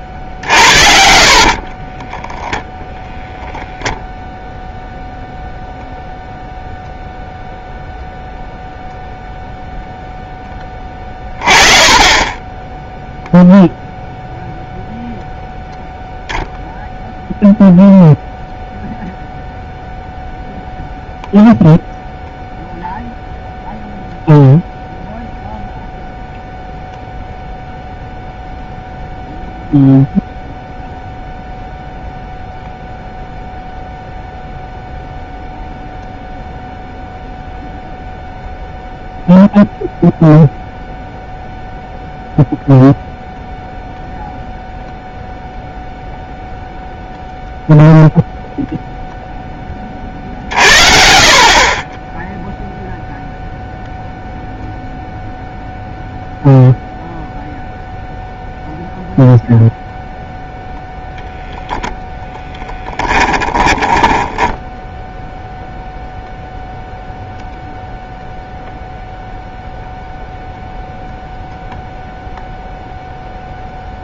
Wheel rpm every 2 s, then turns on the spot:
50, 0, 0, 0, 0, 20, 10, 0, 0, 0, 0, 0, 0, 0, 0, 0, 0, 0, 0, 0, 0, 0, 0, 0, 0, 50, 0, 0, 0, 0, 0, 10, 0, 0, 0, 0, 0.
0-2 10-14 50-52 62-64